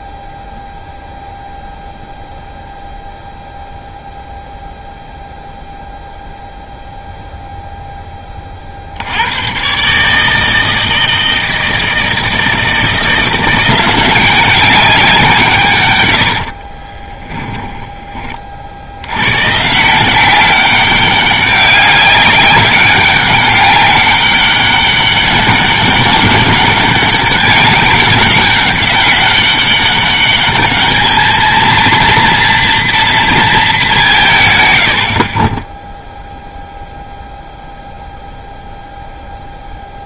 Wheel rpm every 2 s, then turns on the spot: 0, 0, 0, 0, 70, 160, 170, 180, 20, 60, 190, 200, 200, 200, 190, 210, 230, 80, 0, 0.
16-18